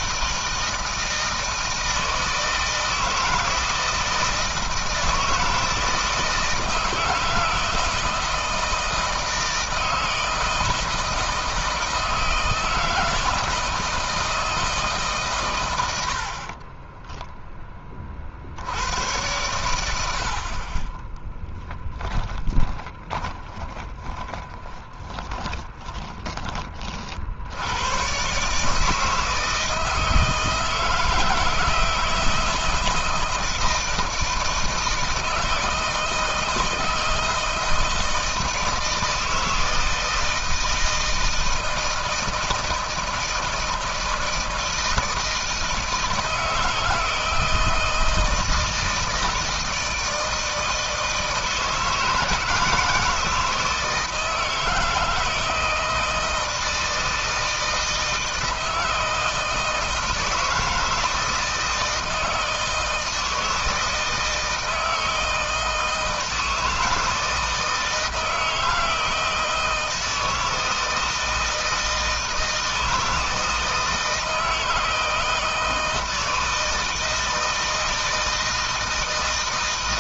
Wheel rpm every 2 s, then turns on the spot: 160, 160, 160, 160, 160, 160, 160, 160, 30, 70, 30, 20, 20, 30, 150, 160, 160, 160, 160, 160, 160, 160, 160, 160, 160, 160, 160, 160, 160, 160, 160, 160, 160, 160, 160, 160, 160, 160, 160, 160.
16-18 20-26